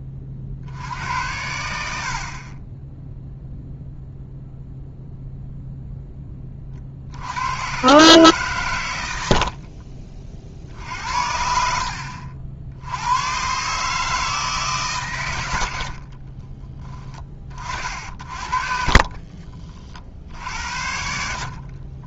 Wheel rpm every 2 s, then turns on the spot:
70, 20, 0, 30, 120, 50, 80, 140, 20, 50, 70.
16-20